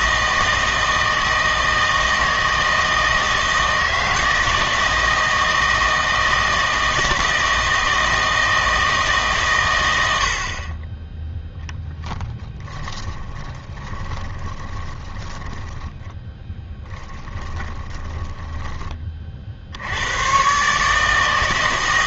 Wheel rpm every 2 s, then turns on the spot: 160, 160, 160, 160, 160, 30, 10, 20, 10, 20, 140.
12-18